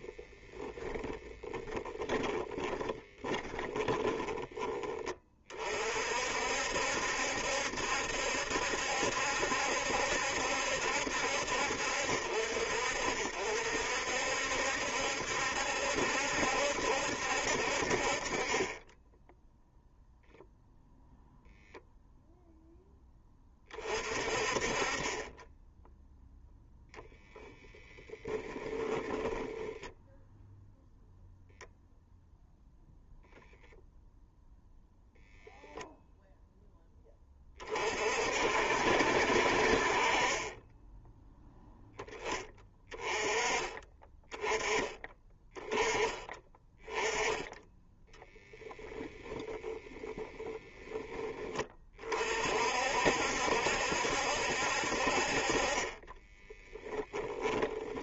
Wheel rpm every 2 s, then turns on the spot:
10, 20, 20, 70, 70, 70, 60, 70, 70, 20, 0, 0, 30, 0, 10, 0, 0, 0, 10, 60, 20, 20, 20, 20, 20, 10, 60, 60, 10.
2-4 28-30 48-50 56-58